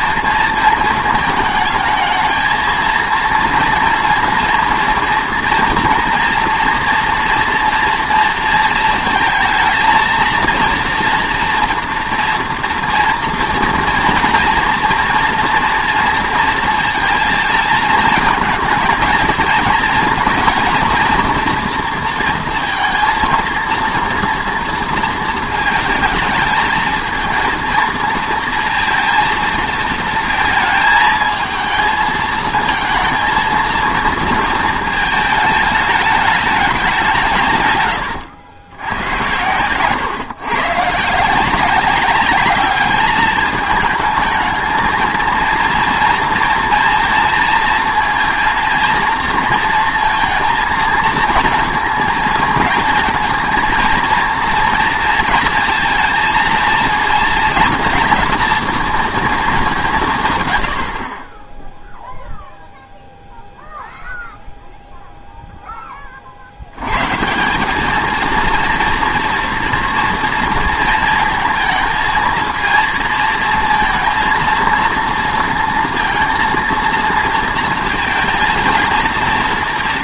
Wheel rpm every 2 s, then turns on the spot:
230, 220, 230, 230, 230, 230, 230, 230, 230, 220, 230, 230, 230, 220, 230, 220, 220, 220, 210, 100, 140, 200, 220, 240, 230, 230, 220, 230, 230, 230, 90, 0, 0, 90, 230, 230, 230, 230, 230, 230.
none